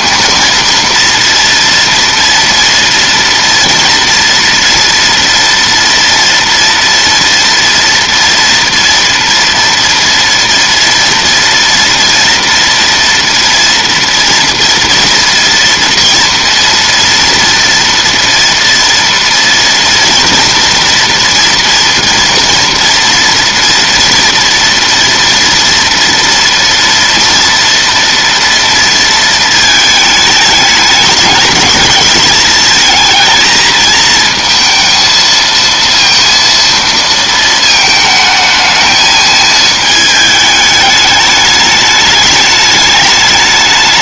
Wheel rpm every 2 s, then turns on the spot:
230, 230, 230, 230, 230, 230, 230, 230, 230, 230, 230, 230, 230, 230, 230, 210, 220, 230, 230, 220, 210, 210.
none